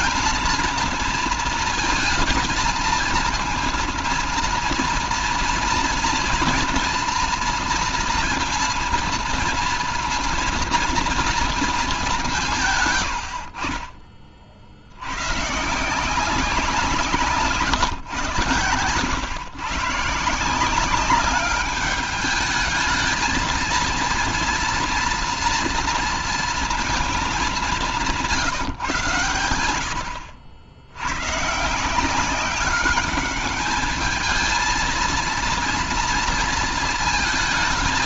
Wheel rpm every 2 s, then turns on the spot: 230, 230, 230, 230, 230, 230, 70, 120, 150, 130, 200, 220, 240, 200, 90, 130, 210, 230, 220.
none